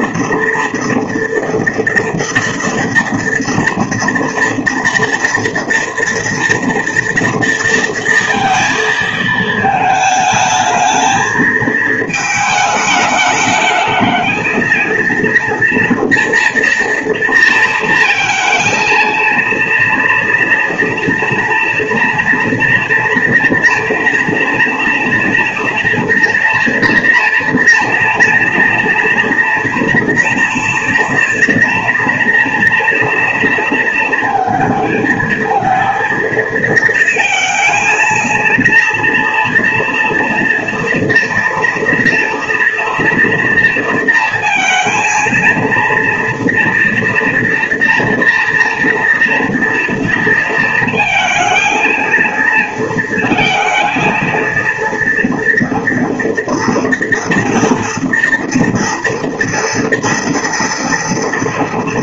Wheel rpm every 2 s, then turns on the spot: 230, 230, 230, 230, 220, 220, 210, 230, 230, 230, 230, 230, 230, 230, 240, 230, 230, 220, 230, 230, 230, 230, 230, 230, 230, 230, 230, 230, 230, 230, 230.
none